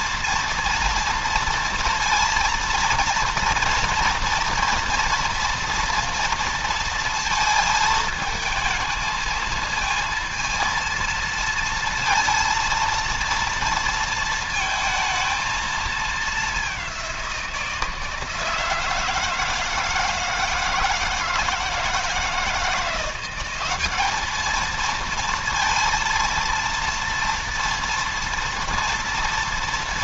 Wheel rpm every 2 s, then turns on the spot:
230, 230, 230, 230, 220, 230, 230, 220, 190, 160, 160, 170, 230, 230, 230.
none